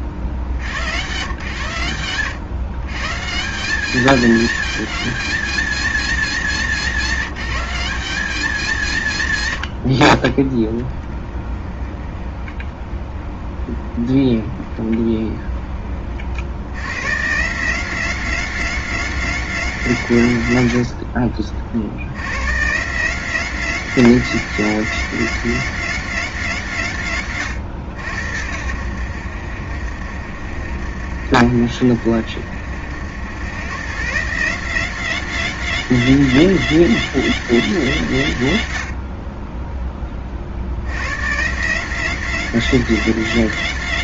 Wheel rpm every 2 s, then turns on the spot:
70, 110, 220, 180, 180, 20, 10, 10, 90, 210, 100, 130, 210, 190, 90, 70, 70, 180, 210, 110, 70, 210.
12-16